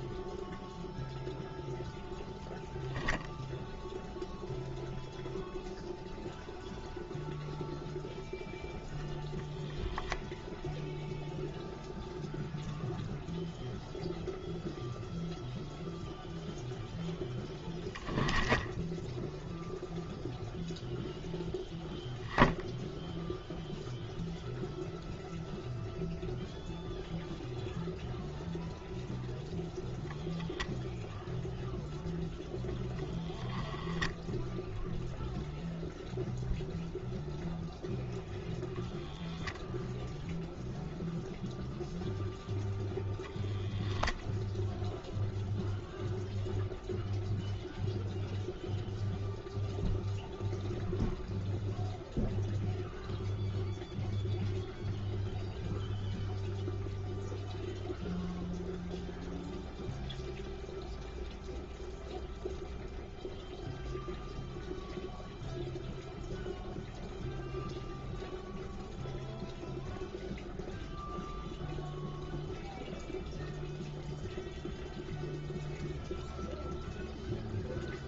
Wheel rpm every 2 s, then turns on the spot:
0, 0, 0, 0, 0, 0, 0, 0, 0, 0, 0, 0, 0, 0, 0, 0, 0, 0, 0, 0, 0, 0, 0, 0, 0, 0, 0, 0, 0, 0, 0, 0, 0, 0, 0, 0, 0, 0, 0.
none